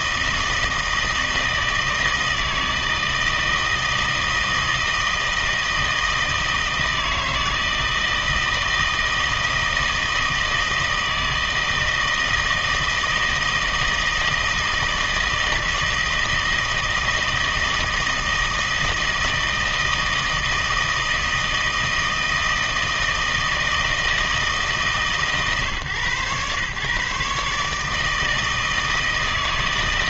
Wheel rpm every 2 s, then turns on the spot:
160, 160, 160, 160, 160, 160, 160, 160, 160, 160, 160, 160, 150, 130, 160.
none